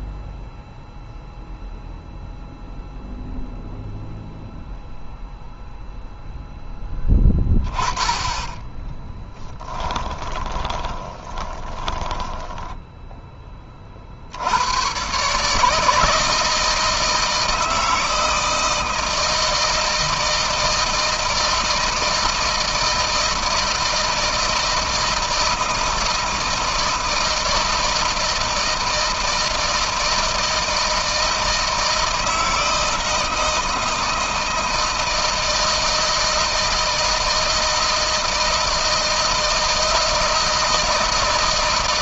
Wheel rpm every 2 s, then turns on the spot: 0, 0, 0, 10, 20, 20, 10, 120, 160, 160, 160, 160, 160, 160, 160, 160, 160, 160, 160, 160, 160.
8-12